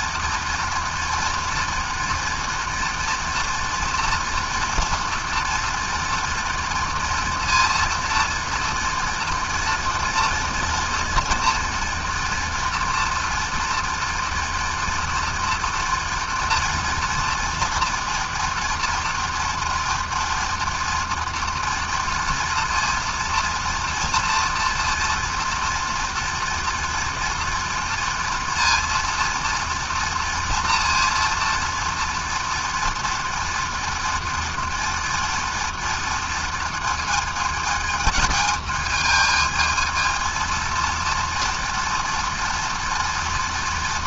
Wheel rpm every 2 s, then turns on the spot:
230, 230, 240, 230, 230, 230, 230, 240, 230, 230, 230, 230, 230, 230, 230, 230, 230, 230, 220, 220, 230, 230.
none